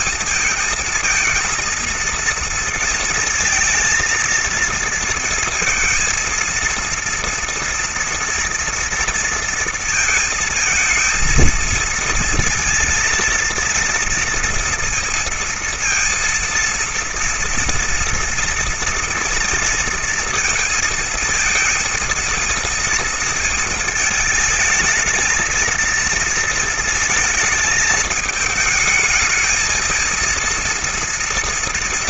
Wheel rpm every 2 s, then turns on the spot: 220, 230, 230, 230, 230, 220, 230, 230, 230, 240, 230, 230, 220, 230, 220, 230.
none